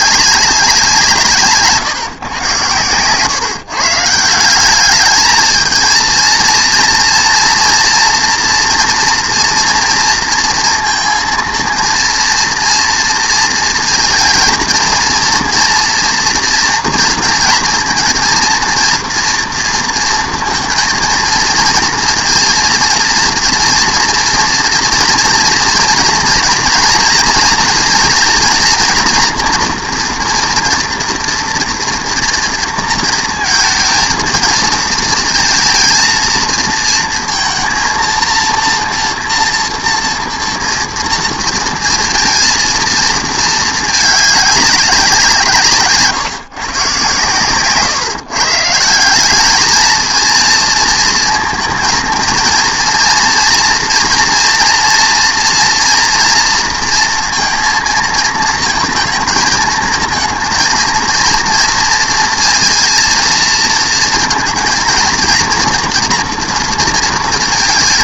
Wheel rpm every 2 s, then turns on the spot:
190, 120, 190, 230, 230, 230, 230, 230, 240, 230, 230, 230, 230, 230, 230, 230, 230, 230, 230, 230, 230, 230, 200, 140, 160, 230, 230, 230, 230, 230, 230, 230, 230, 230.
none